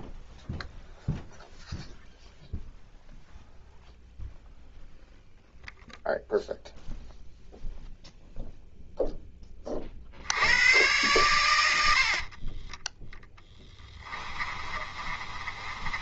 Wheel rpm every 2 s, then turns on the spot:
0, 0, 0, 0, 0, 110, 10, 30.
12-16